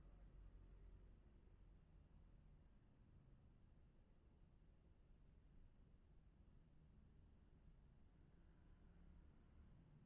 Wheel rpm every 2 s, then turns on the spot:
0, 0, 0, 0, 0.
none